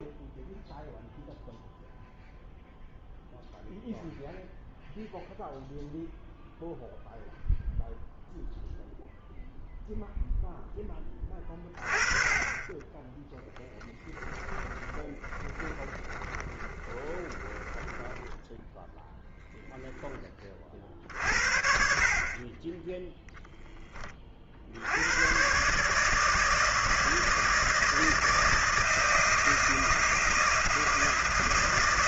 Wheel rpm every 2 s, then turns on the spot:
0, 0, 0, 0, 0, 10, 20, 10, 20, 10, 40, 20, 80, 160, 160, 160.
14-18